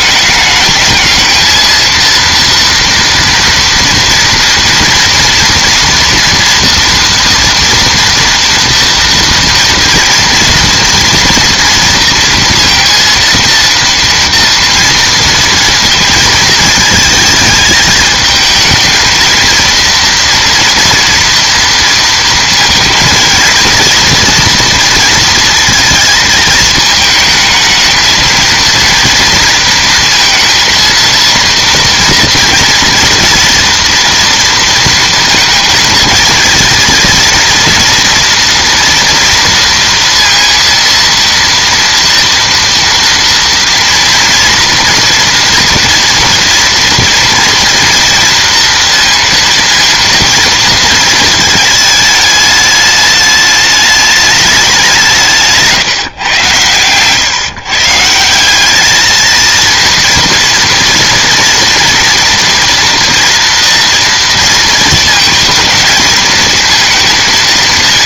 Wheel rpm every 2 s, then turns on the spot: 210, 230, 230, 240, 230, 230, 230, 230, 220, 220, 230, 230, 230, 220, 230, 230, 230, 240, 230, 230, 230, 240, 230, 230, 230, 230, 210, 200, 130, 190, 230, 230, 230, 230.
none